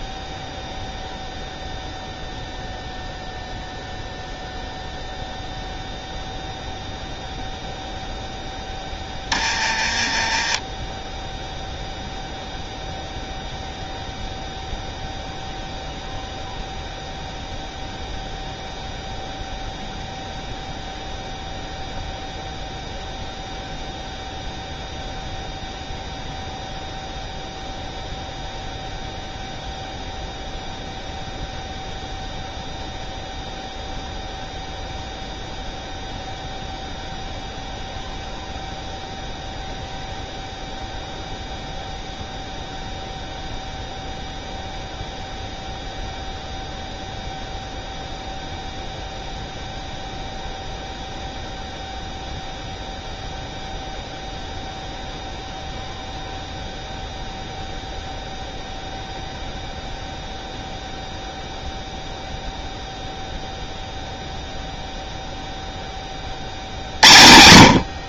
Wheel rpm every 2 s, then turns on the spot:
0, 0, 0, 0, 10, 10, 0, 0, 0, 0, 0, 0, 0, 0, 0, 0, 0, 0, 0, 0, 0, 0, 0, 0, 0, 0, 0, 0, 0, 0, 0, 0, 0, 70.
none